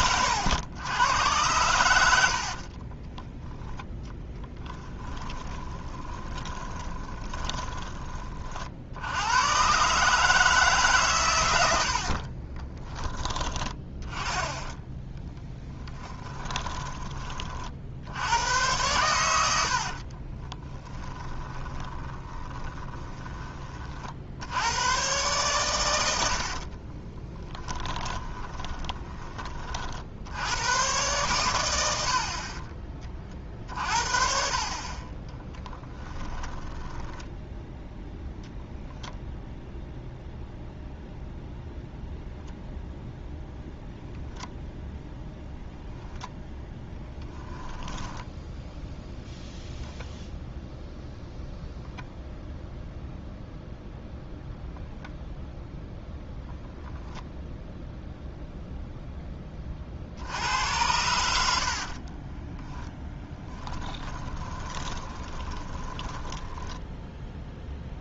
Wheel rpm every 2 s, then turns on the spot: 110, 40, 20, 20, 50, 140, 20, 10, 20, 110, 20, 20, 110, 40, 20, 110, 40, 40, 10, 0, 0, 0, 0, 10, 0, 0, 0, 0, 0, 0, 90, 10, 20, 10.
2-8 12-14 16-18 20-24 26-30 36-38 46-48 64-66